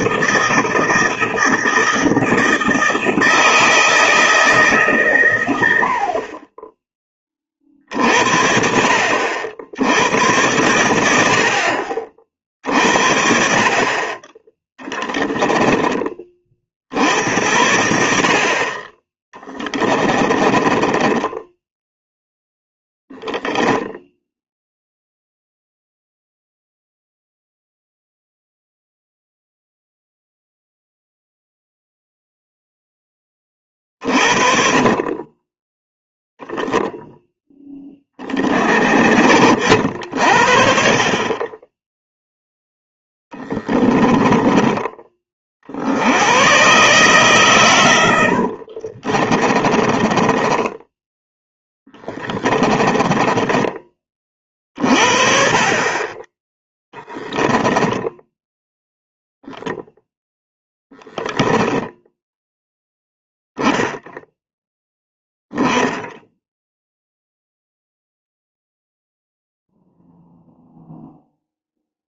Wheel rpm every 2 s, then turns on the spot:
160, 160, 140, 20, 60, 90, 50, 10, 60, 30, 20, 0, 0, 0, 0, 0, 10, 30, 0, 50, 40, 10, 20, 130, 40, 10, 20, 40, 10, 0, 0, 0, 0, 0, 0, 0.
14-16 20-22 48-54